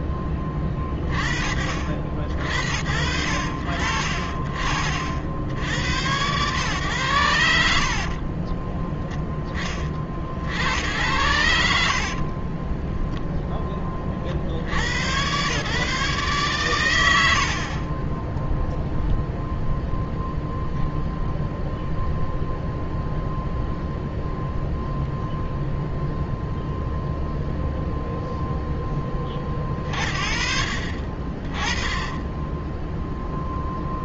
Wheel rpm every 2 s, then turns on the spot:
30, 60, 50, 110, 30, 80, 10, 90, 100, 0, 0, 0, 0, 0, 20, 30, 0.
8-10